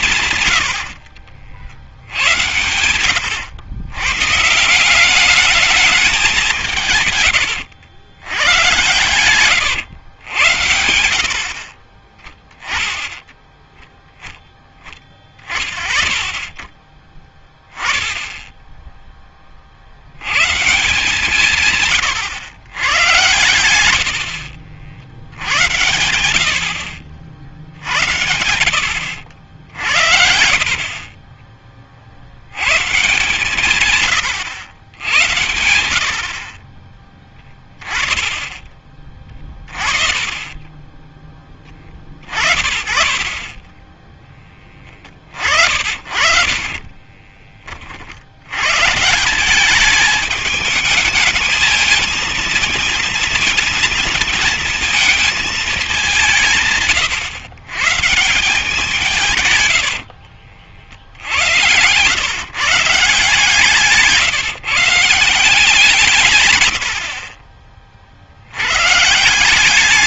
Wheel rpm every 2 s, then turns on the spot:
130, 100, 150, 180, 110, 100, 10, 10, 20, 10, 130, 120, 70, 80, 90, 60, 100, 110, 50, 20, 20, 30, 10, 50, 100, 210, 220, 220, 150, 160, 70, 120, 150, 120, 80.
2-4 46-48 60-62